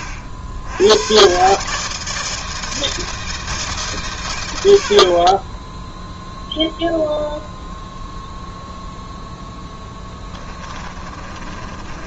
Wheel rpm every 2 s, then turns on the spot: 80, 160, 80, 0, 0, 20.
10-12